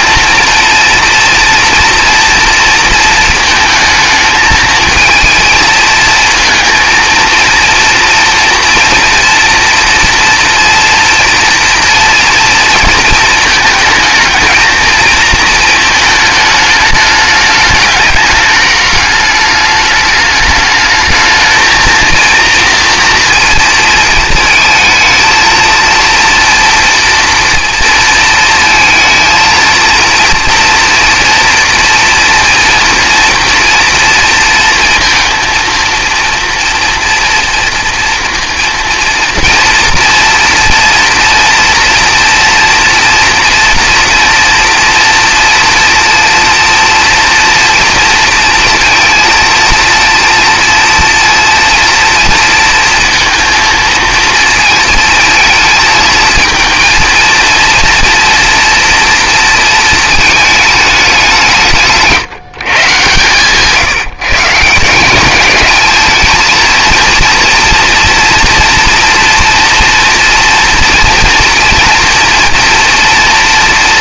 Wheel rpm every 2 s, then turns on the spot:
230, 230, 220, 230, 230, 230, 230, 220, 210, 210, 220, 230, 230, 230, 230, 230, 230, 230, 230, 230, 230, 230, 230, 230, 230, 230, 230, 230, 230, 230, 210, 140, 170, 230, 230, 230, 230.
none